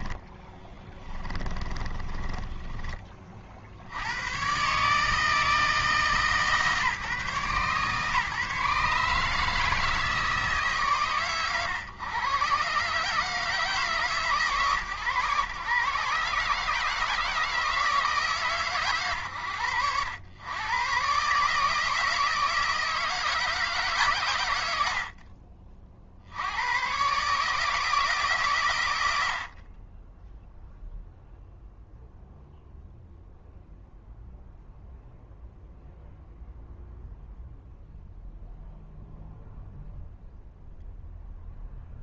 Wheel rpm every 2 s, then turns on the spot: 30, 20, 140, 150, 140, 140, 130, 130, 150, 120, 120, 160, 90, 100, 130, 0, 0, 0, 0, 0, 0.
0-2